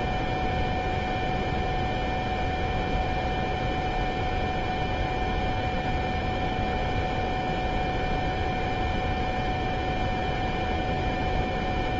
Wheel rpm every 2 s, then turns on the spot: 0, 0, 0, 0, 0, 0.
none